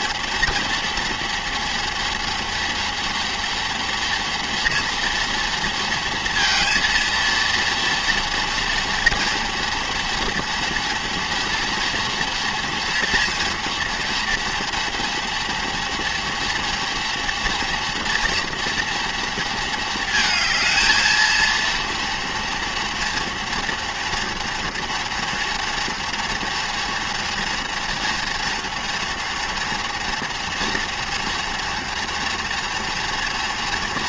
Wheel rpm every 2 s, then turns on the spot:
230, 230, 230, 230, 230, 230, 230, 230, 230, 230, 220, 230, 230, 230, 230, 230, 240.
none